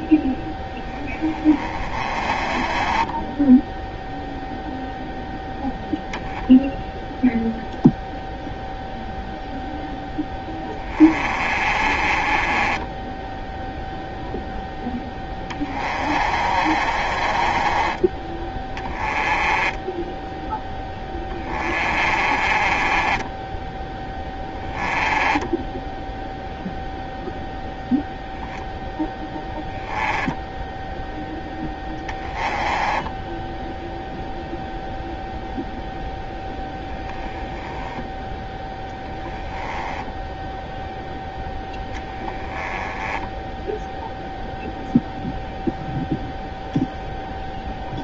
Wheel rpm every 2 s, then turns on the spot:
10, 20, 0, 0, 0, 20, 20, 0, 40, 20, 10, 30, 10, 0, 0, 0, 10, 0, 0, 0, 0, 10, 0, 0.
2-4 10-14 16-26 32-34 42-44